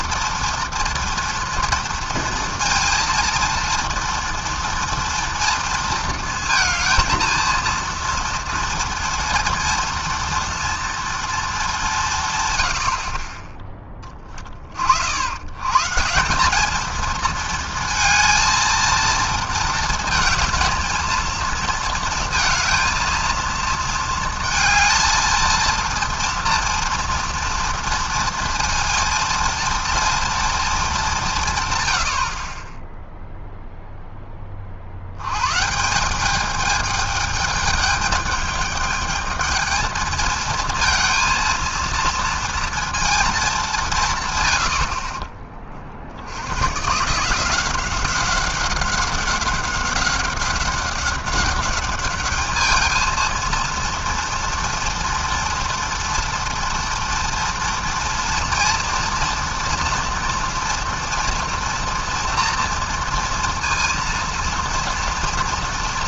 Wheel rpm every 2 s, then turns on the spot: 240, 230, 240, 230, 230, 220, 40, 90, 220, 230, 220, 230, 230, 230, 230, 180, 0, 110, 210, 220, 230, 230, 40, 160, 200, 190, 230, 230, 230, 230, 230, 230, 230.
none